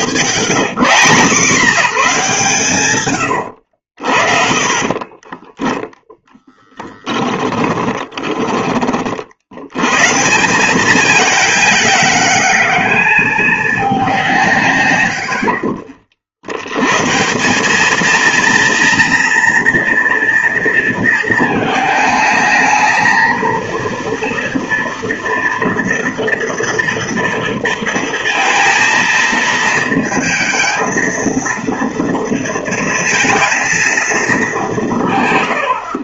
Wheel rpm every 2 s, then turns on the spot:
120, 130, 40, 10, 20, 190, 220, 140, 100, 230, 230, 220, 230, 230, 230, 230, 230, 180.
4-8